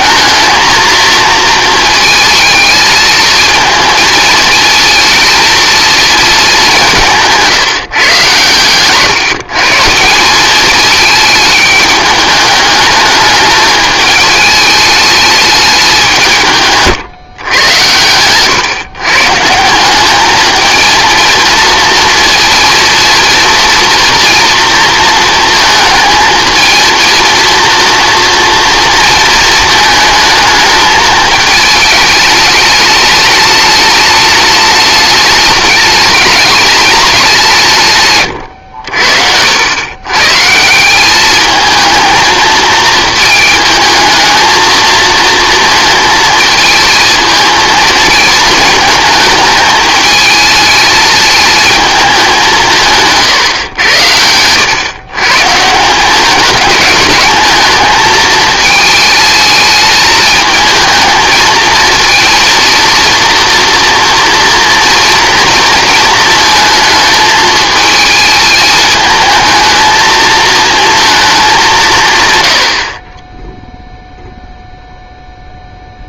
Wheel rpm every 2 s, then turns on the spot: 230, 220, 230, 180, 120, 210, 210, 210, 150, 130, 220, 230, 230, 220, 230, 210, 210, 210, 210, 80, 180, 220, 220, 220, 220, 220, 160, 120, 210, 220, 220, 230, 230, 220, 210, 220, 70, 0.
none